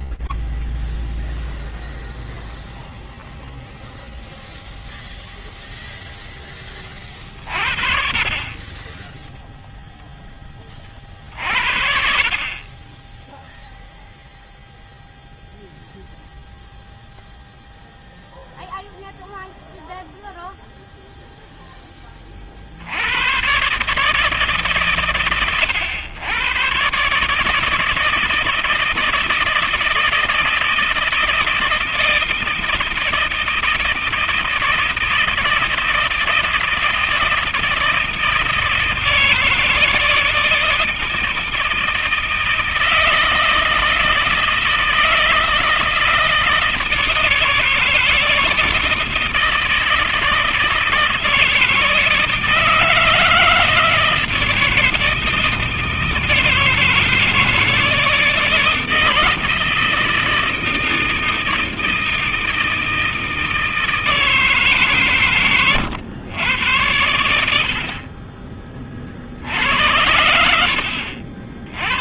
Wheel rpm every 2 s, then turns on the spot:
0, 0, 0, 10, 40, 30, 30, 0, 0, 0, 0, 130, 120, 160, 160, 170, 160, 160, 160, 160, 160, 160, 160, 160, 160, 160, 160, 160, 160, 160, 160, 160, 120, 70, 60, 70.
64-66